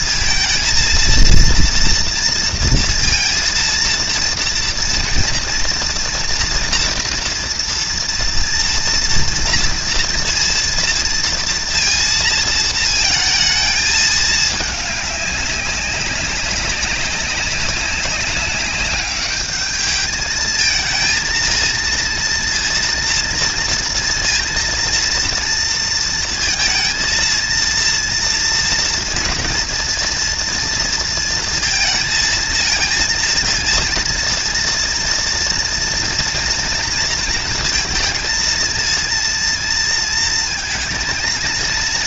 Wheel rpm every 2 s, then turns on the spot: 230, 230, 240, 240, 230, 230, 230, 210, 190, 200, 220, 230, 230, 230, 230, 230, 230, 230, 230, 220, 230.
none